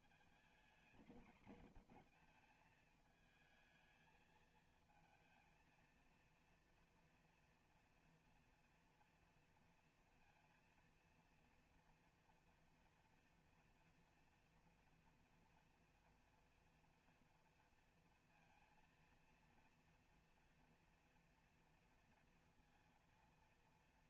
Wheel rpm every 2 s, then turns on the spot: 230, 230, 220, 230, 230, 230, 240, 230, 240, 230, 230, 230.
none